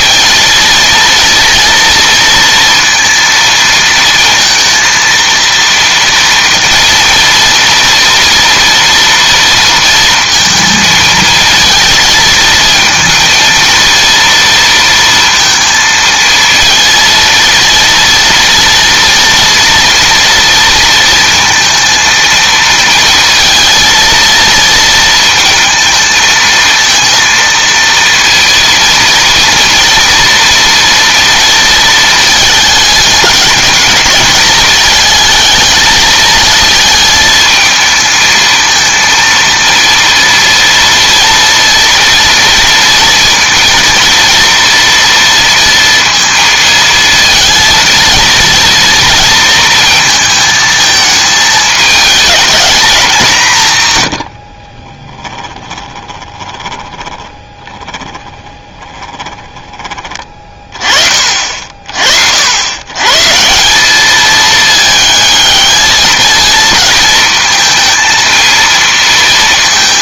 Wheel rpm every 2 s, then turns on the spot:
230, 230, 230, 230, 230, 230, 220, 230, 230, 230, 230, 230, 230, 220, 230, 230, 220, 210, 220, 220, 240, 230, 230, 230, 230, 220, 220, 50, 20, 20, 30, 90, 220, 220, 230.
54-60